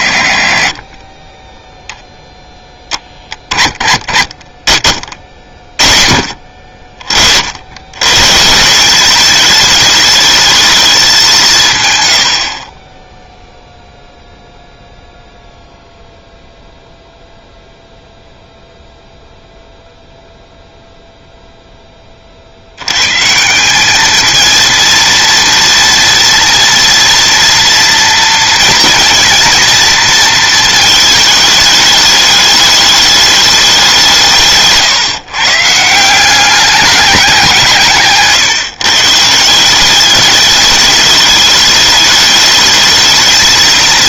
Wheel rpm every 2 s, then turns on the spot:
30, 20, 40, 40, 190, 210, 30, 0, 0, 0, 0, 100, 230, 230, 230, 220, 210, 140, 200, 150, 210, 220.
none